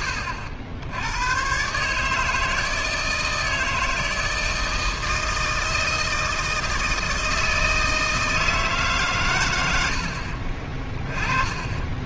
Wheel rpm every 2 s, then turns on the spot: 100, 160, 160, 160, 140, 20.
none